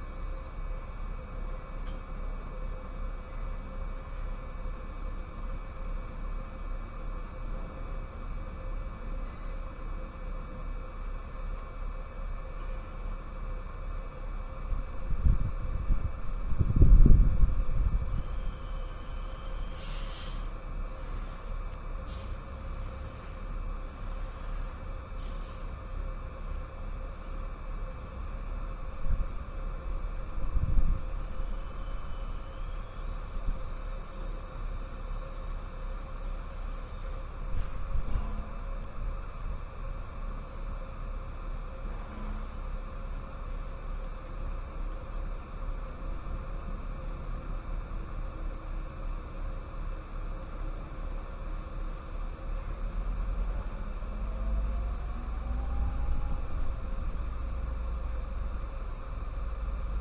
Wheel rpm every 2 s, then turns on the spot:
0, 0, 0, 0, 0, 0, 0, 0, 0, 0, 0, 0, 0, 0, 0, 0, 0, 0, 0, 0, 0, 0, 0, 0, 0, 0, 0, 0, 0, 0.
none